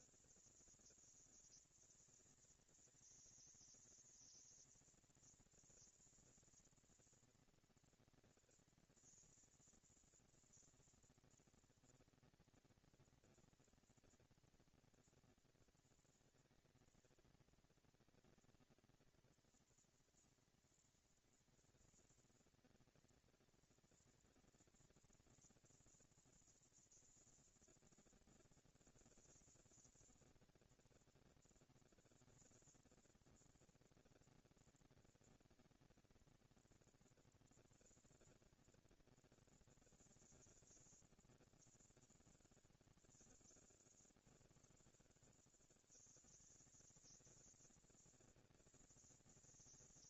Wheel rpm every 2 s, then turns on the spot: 220, 220, 230, 230, 230, 230, 230, 230, 230, 230, 240, 230, 240, 230, 240, 230, 230, 230, 230, 230, 210, 150, 80, 150, 220.
none